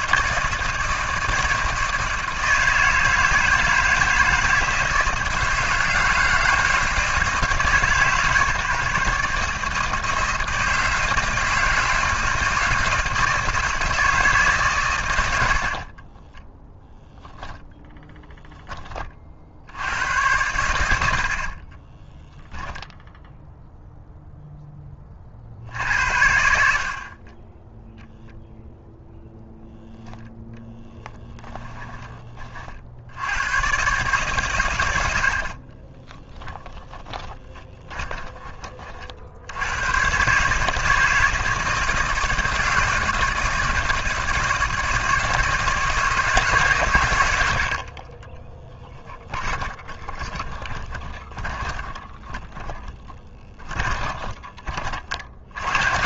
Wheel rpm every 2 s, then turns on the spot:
160, 160, 160, 160, 140, 160, 170, 120, 10, 10, 90, 0, 10, 60, 0, 30, 50, 90, 10, 50, 160, 160, 160, 140, 20, 20, 10, 30.
30-32 36-38 48-54